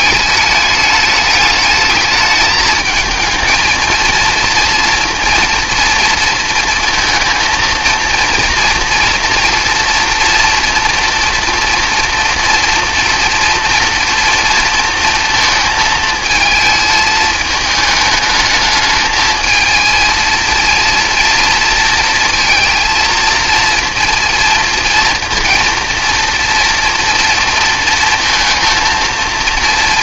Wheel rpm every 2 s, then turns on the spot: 210, 220, 230, 230, 230, 240, 230, 230, 220, 220, 230, 230, 230, 230, 230.
none